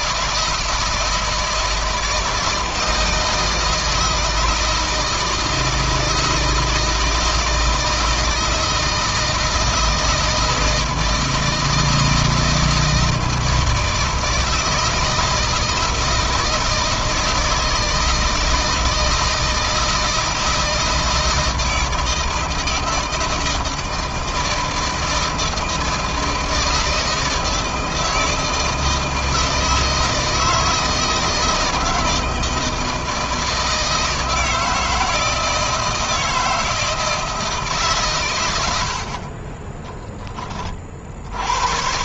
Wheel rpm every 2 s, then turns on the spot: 160, 160, 160, 160, 160, 160, 160, 160, 160, 160, 160, 160, 160, 160, 160, 160, 160, 160, 160, 70, 50.
none